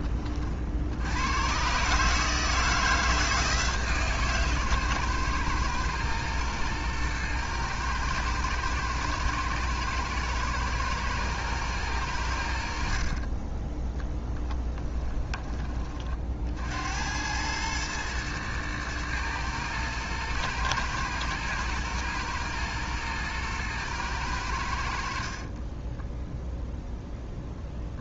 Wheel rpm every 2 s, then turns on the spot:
70, 160, 130, 120, 110, 110, 60, 20, 80, 110, 120, 110, 70, 0.
14-16